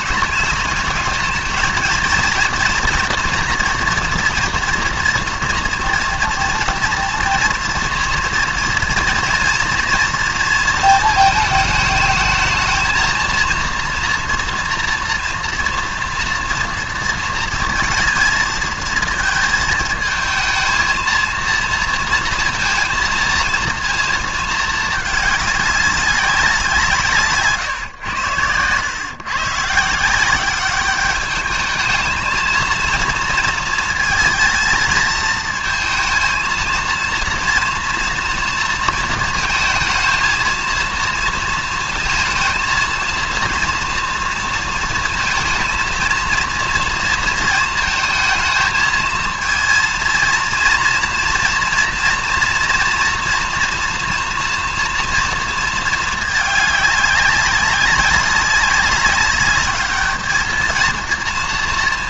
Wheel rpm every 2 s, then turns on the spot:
210, 240, 230, 230, 240, 230, 220, 230, 240, 230, 220, 230, 220, 190, 110, 190, 220, 230, 230, 230, 230, 230, 230, 230, 220, 230, 230, 230, 210, 200, 220.
none